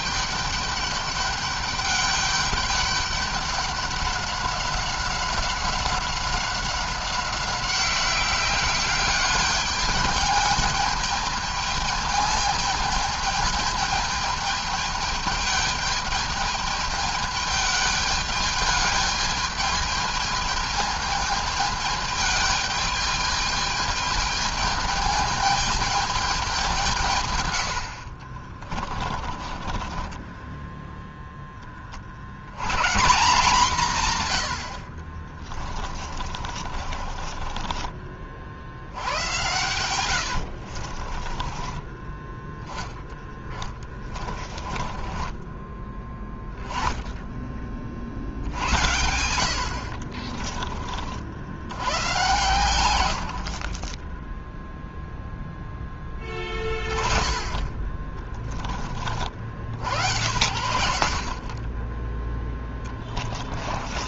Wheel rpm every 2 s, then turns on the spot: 200, 200, 200, 190, 190, 210, 220, 210, 210, 210, 220, 210, 220, 190, 50, 20, 80, 100, 40, 50, 70, 10, 30, 10, 70, 40, 130, 10, 10, 20, 100, 20.
28-32 36-38 40-42 44-46 50-52